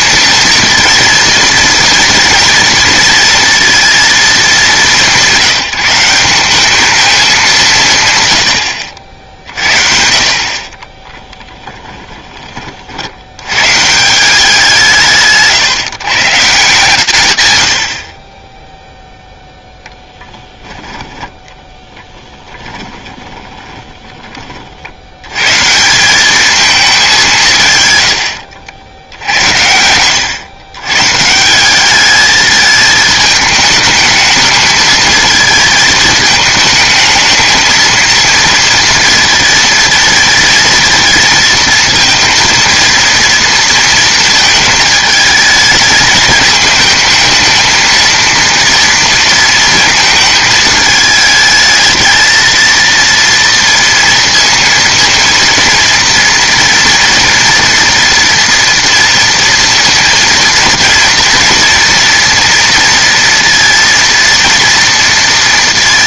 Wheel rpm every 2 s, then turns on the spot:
230, 230, 200, 200, 90, 50, 30, 180, 150, 0, 10, 10, 40, 210, 80, 130, 220, 220, 220, 230, 230, 230, 220, 220, 230, 220, 230, 230, 230, 230, 230, 230, 230.
10-12 22-24